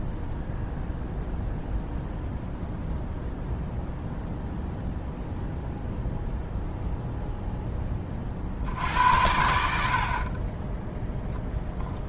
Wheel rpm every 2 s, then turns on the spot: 0, 0, 0, 0, 70, 10.
none